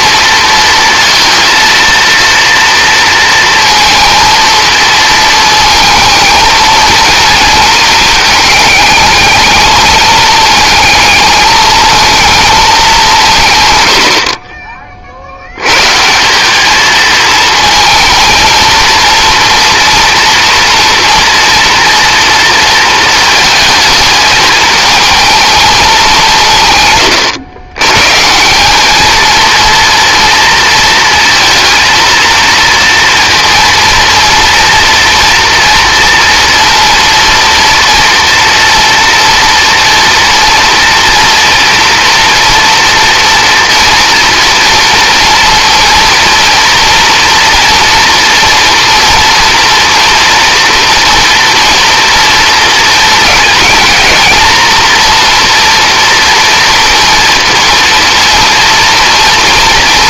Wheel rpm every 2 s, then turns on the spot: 230, 230, 220, 220, 210, 210, 210, 50, 220, 230, 230, 230, 220, 130, 210, 230, 230, 230, 230, 230, 230, 230, 230, 230, 230, 230, 230, 240, 230, 230.
none